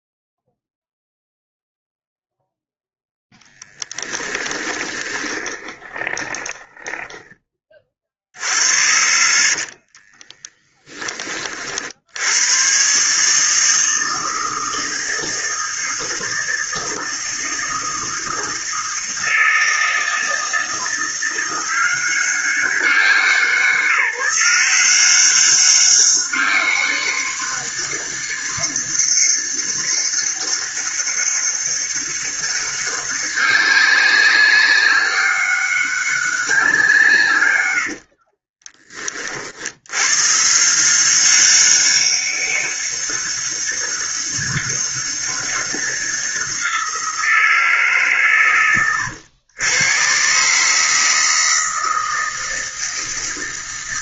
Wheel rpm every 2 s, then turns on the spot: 0, 0, 20, 10, 70, 20, 130, 160, 160, 160, 170, 190, 180, 200, 200, 200, 200, 200, 160, 30, 170, 200, 200, 180, 100, 150, 160.
4-10